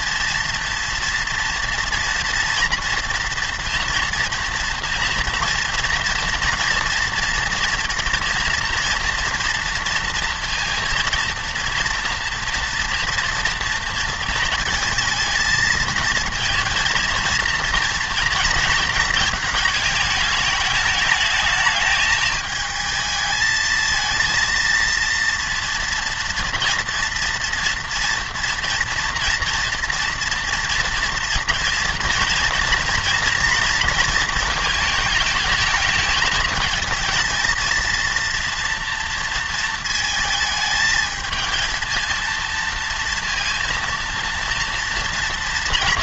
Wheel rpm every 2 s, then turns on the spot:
230, 230, 230, 240, 240, 230, 240, 230, 230, 230, 210, 220, 230, 230, 230, 230, 230, 220, 210, 230, 220, 230, 230.
none